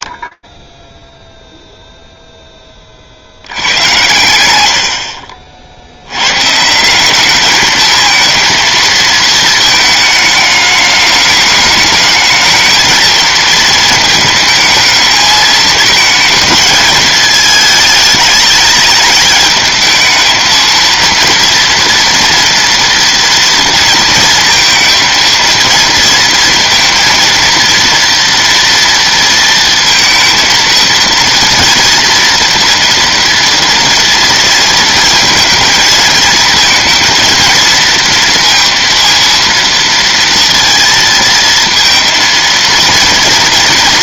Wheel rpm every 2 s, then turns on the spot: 60, 30, 80, 170, 230, 210, 230, 220, 220, 210, 230, 230, 230, 230, 230, 230, 230, 230, 230, 230, 230, 230.
none